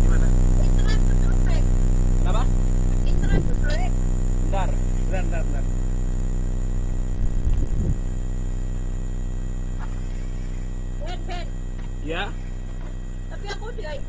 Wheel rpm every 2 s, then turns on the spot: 0, 0, 0, 0, 0, 0, 0.
none